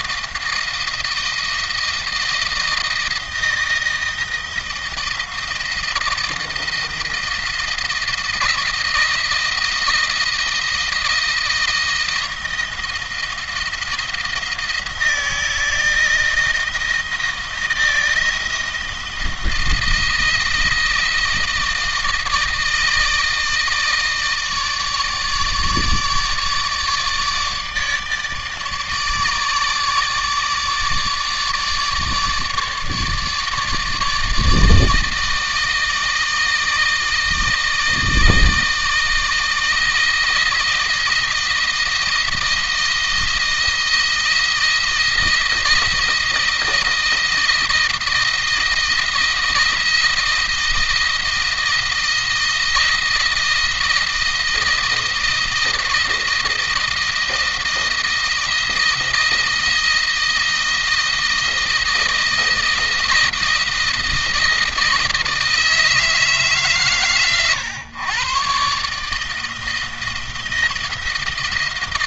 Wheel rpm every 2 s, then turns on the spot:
170, 170, 160, 160, 170, 170, 170, 170, 160, 160, 160, 160, 150, 150, 150, 150, 150, 160, 160, 160, 160, 160, 170, 160, 160, 160, 160, 160, 160, 160, 160, 160, 160, 140, 140, 170.
none